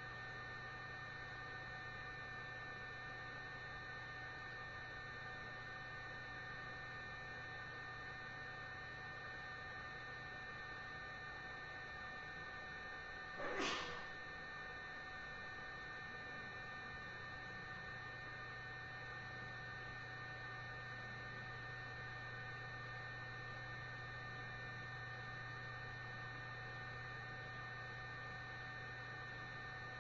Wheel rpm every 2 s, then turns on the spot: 0, 0, 0, 0, 0, 0, 0, 0, 0, 0, 0, 0, 0, 0, 0.
none